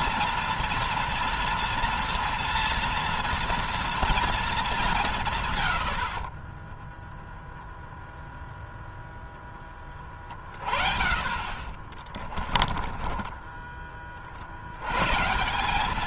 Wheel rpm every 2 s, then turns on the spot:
230, 230, 220, 40, 0, 50, 30, 60.
6-8 12-14